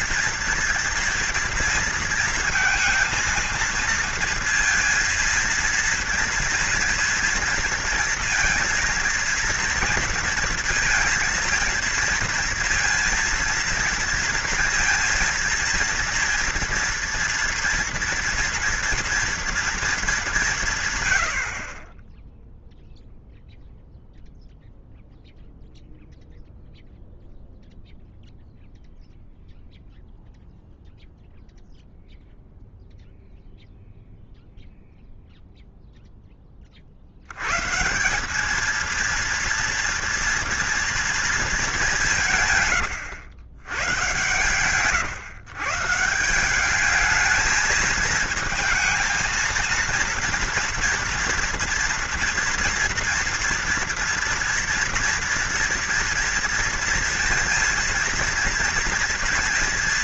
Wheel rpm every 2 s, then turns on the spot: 230, 220, 230, 230, 230, 230, 230, 230, 240, 230, 170, 0, 0, 0, 0, 0, 0, 0, 30, 210, 230, 140, 120, 190, 230, 230, 230, 230, 230, 230.
none